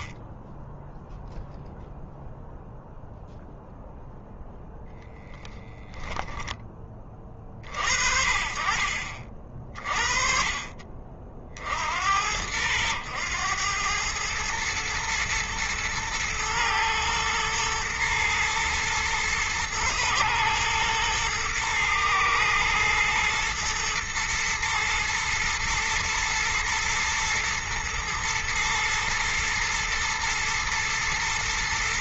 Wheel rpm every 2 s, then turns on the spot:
0, 0, 0, 30, 50, 40, 90, 110, 110, 110, 120, 110, 110, 110, 110, 120.
none